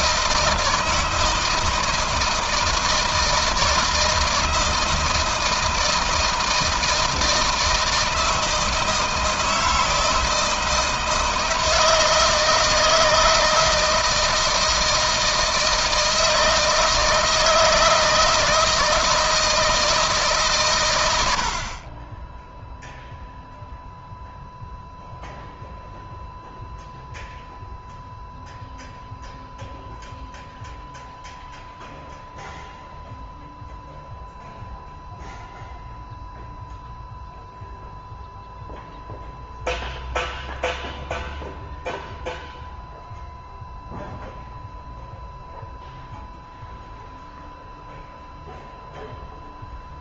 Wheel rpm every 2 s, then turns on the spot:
160, 160, 160, 160, 160, 160, 160, 160, 160, 160, 110, 0, 0, 0, 0, 0, 0, 0, 0, 0, 0, 0, 0, 0, 0.
none